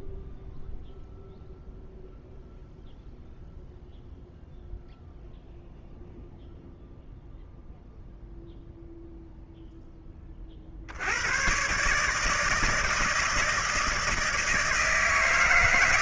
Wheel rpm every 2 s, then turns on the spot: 0, 0, 0, 0, 0, 60, 160, 160.
none